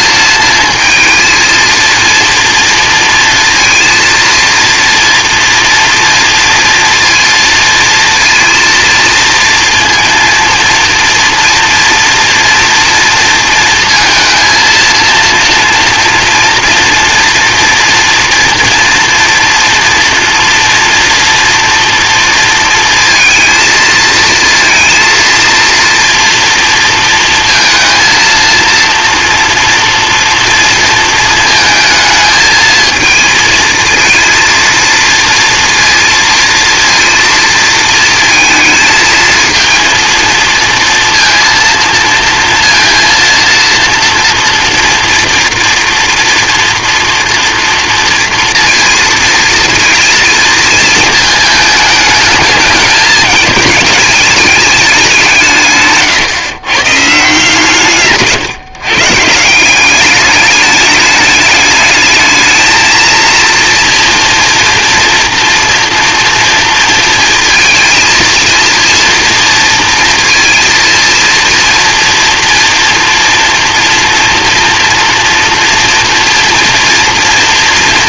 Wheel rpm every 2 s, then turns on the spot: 220, 230, 230, 230, 230, 230, 230, 230, 240, 230, 230, 230, 230, 230, 230, 230, 220, 230, 230, 220, 230, 230, 230, 230, 230, 230, 220, 210, 140, 120, 210, 220, 230, 230, 230, 230, 230, 240, 240.
none